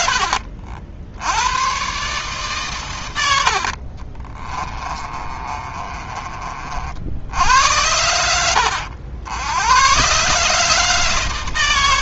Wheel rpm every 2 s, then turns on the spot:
70, 110, 30, 60, 80, 140.
4-6